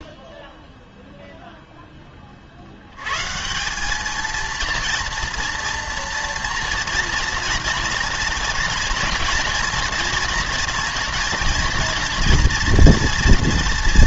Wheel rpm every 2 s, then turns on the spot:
0, 80, 230, 230, 240, 230, 230.
none